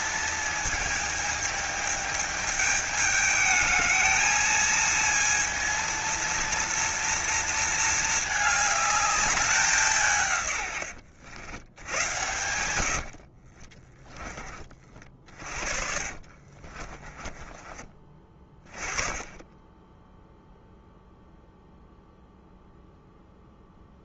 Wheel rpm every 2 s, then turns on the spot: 220, 210, 220, 230, 210, 110, 90, 40, 30, 20, 0, 0.
16-18